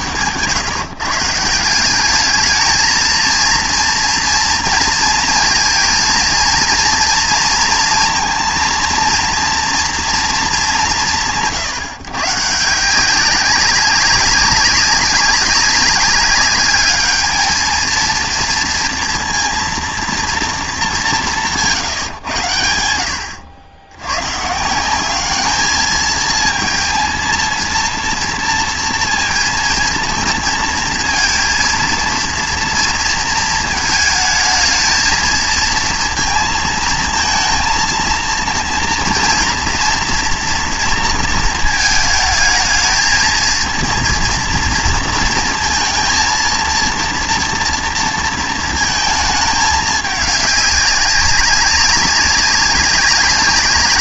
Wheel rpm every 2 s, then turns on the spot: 120, 220, 230, 230, 230, 220, 150, 190, 200, 230, 220, 100, 150, 220, 230, 230, 230, 220, 230, 230, 230, 220, 230, 230, 230, 200, 200.
none